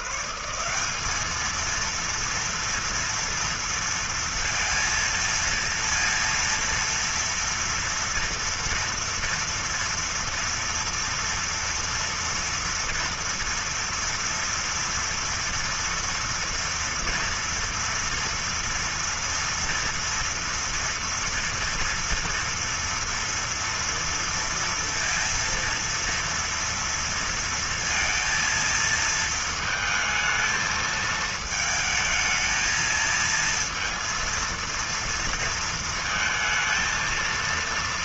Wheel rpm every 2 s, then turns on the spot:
180, 230, 230, 230, 230, 230, 230, 230, 230, 230, 230, 240, 230, 230, 230, 220, 220, 230, 230.
none